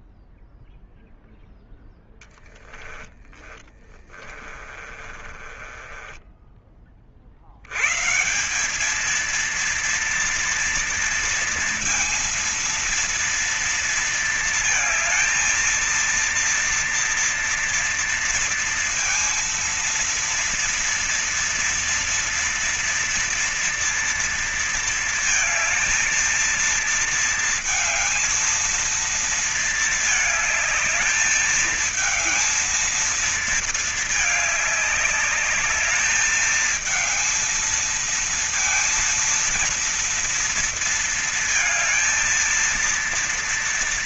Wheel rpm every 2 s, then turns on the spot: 0, 10, 20, 20, 130, 230, 230, 230, 230, 230, 230, 230, 230, 220, 220, 220, 220, 220, 210, 220, 230, 230.
2-8